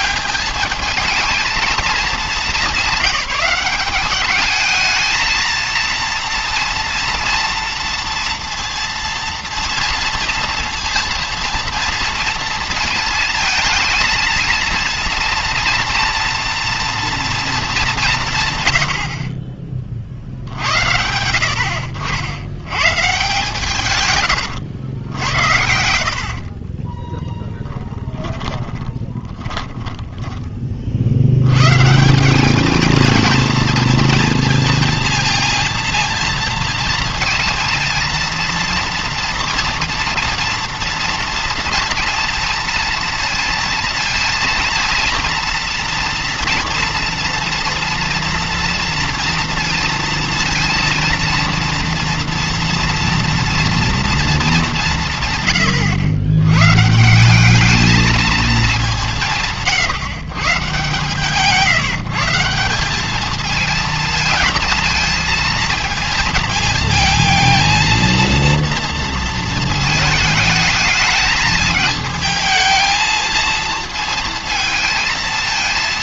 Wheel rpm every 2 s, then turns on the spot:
220, 200, 220, 230, 230, 230, 230, 230, 230, 130, 80, 120, 100, 40, 20, 30, 210, 230, 230, 230, 230, 230, 230, 230, 230, 230, 230, 190, 120, 200, 140, 180, 220, 230, 230, 220, 220, 230.
26-30